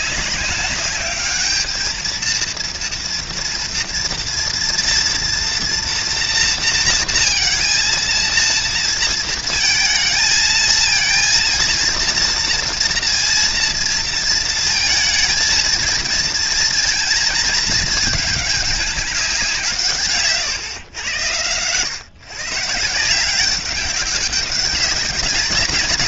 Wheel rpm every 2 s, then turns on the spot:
200, 230, 240, 230, 230, 220, 230, 220, 230, 200, 110, 170, 200.
none